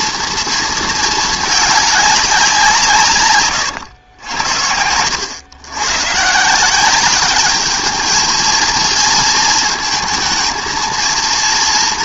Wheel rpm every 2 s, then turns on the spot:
230, 170, 80, 180, 230, 230.
none